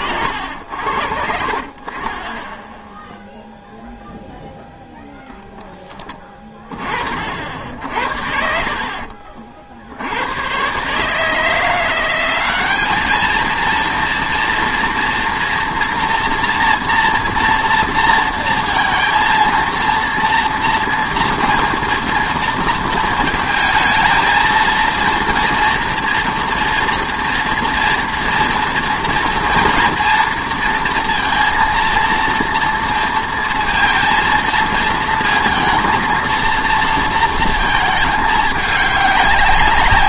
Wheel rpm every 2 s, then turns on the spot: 80, 10, 0, 20, 60, 130, 200, 230, 230, 230, 230, 230, 230, 240, 230, 230, 230, 230, 230, 210.
none